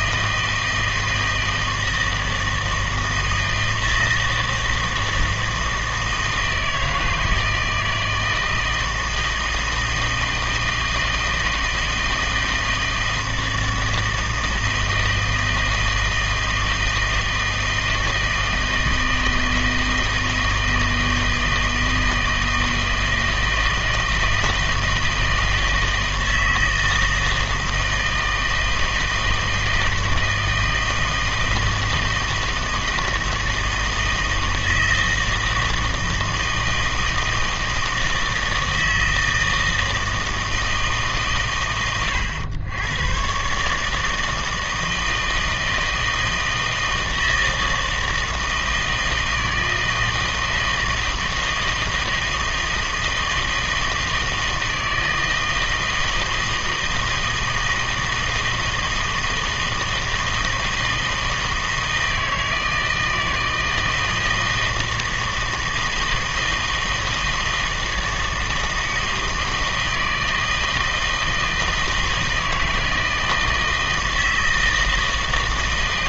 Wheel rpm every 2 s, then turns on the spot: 160, 160, 160, 160, 160, 160, 160, 160, 160, 160, 160, 160, 160, 160, 160, 160, 160, 160, 160, 160, 160, 100, 160, 160, 160, 160, 160, 160, 160, 160, 160, 160, 160, 160, 160, 160, 160, 160.
none